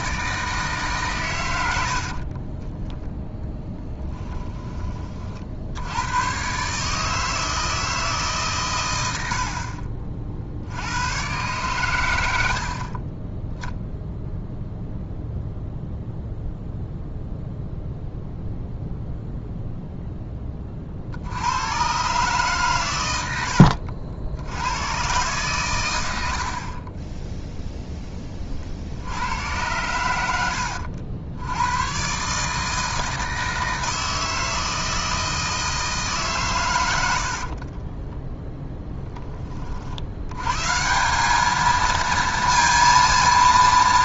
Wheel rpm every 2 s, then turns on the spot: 150, 20, 20, 140, 110, 80, 60, 0, 0, 0, 40, 120, 100, 40, 40, 90, 150, 160, 100, 10, 150, 230.
2-4